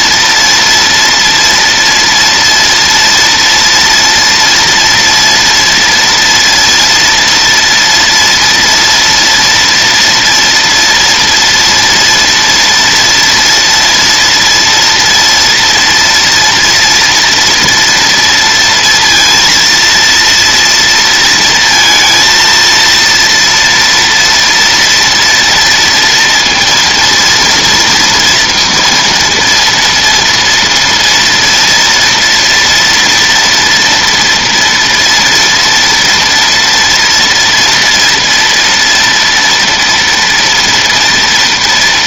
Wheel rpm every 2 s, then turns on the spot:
230, 230, 230, 230, 230, 230, 230, 230, 230, 230, 230, 230, 230, 230, 230, 230, 230, 240, 230, 230, 240.
none